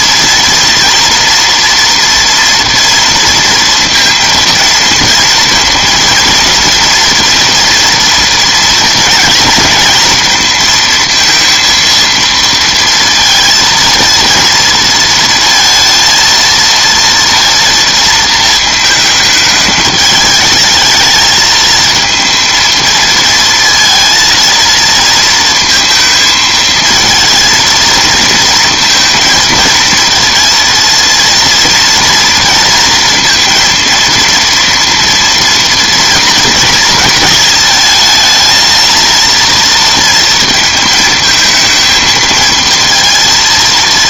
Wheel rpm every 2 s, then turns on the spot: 230, 230, 230, 230, 240, 230, 230, 230, 230, 220, 210, 230, 230, 230, 230, 230, 230, 230, 230, 230, 230, 230.
none